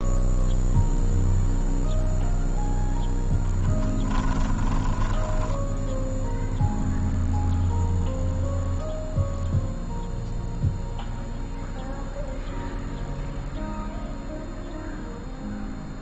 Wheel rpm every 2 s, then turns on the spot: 0, 0, 10, 0, 0, 0, 0, 0.
4-6